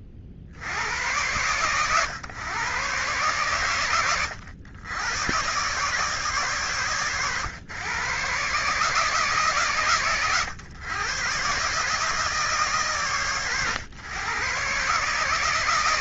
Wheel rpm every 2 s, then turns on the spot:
40, 130, 100, 130, 140, 120, 140, 130.
none